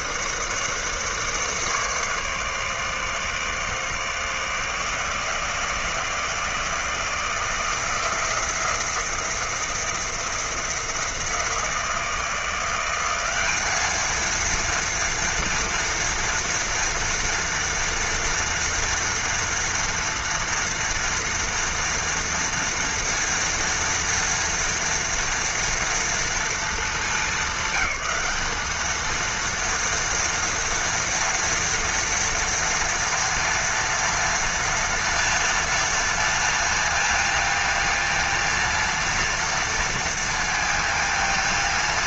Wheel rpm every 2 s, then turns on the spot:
150, 150, 160, 160, 170, 160, 180, 230, 230, 230, 230, 230, 230, 210, 210, 230, 230, 230, 230, 230, 230.
none